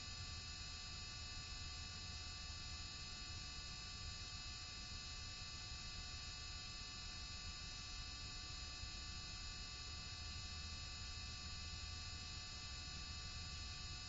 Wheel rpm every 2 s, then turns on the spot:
0, 0, 0, 0, 0, 0, 0.
none